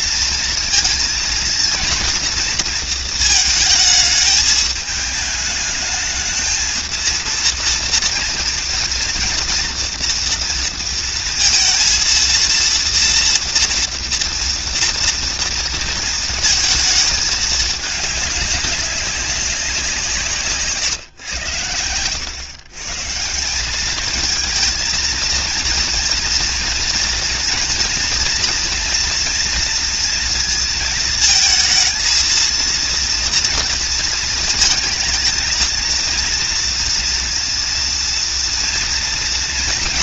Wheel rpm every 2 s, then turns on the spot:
230, 220, 210, 220, 230, 230, 230, 230, 220, 200, 130, 140, 220, 230, 230, 230, 230, 220, 230, 230.
none